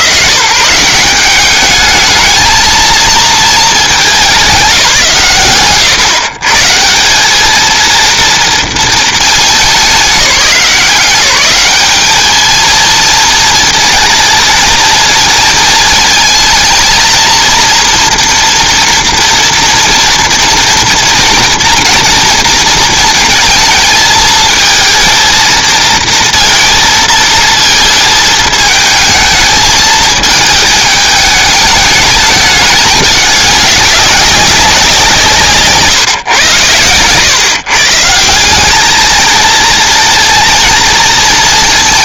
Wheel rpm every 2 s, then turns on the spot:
140, 230, 150, 140, 220, 180, 220, 230, 220, 230, 230, 220, 220, 230, 220, 220, 210, 190, 110, 210, 230.
none